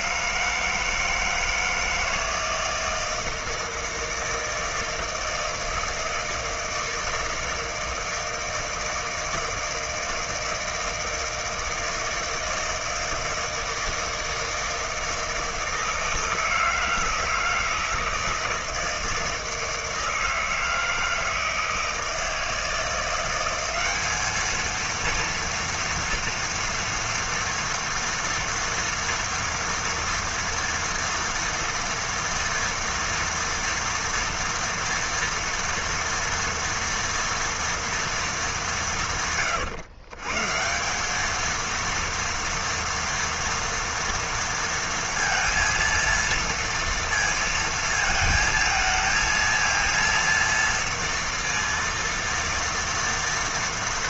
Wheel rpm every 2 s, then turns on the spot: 160, 160, 160, 160, 160, 160, 160, 160, 160, 160, 160, 170, 220, 230, 230, 230, 240, 230, 240, 190, 160, 240, 230, 230, 220, 230, 230.
none